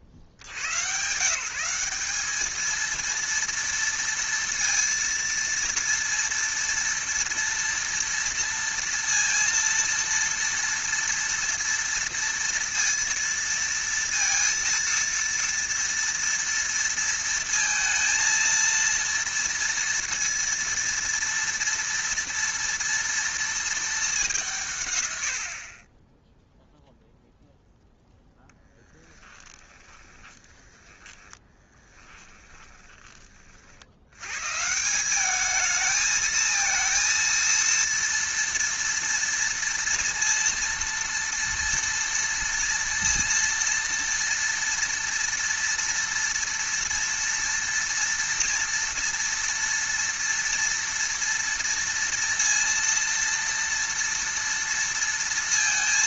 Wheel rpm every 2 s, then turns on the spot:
60, 220, 230, 230, 230, 230, 230, 230, 230, 230, 230, 230, 150, 0, 0, 10, 10, 150, 220, 230, 230, 230, 230, 230, 230, 230, 230, 230.
30-34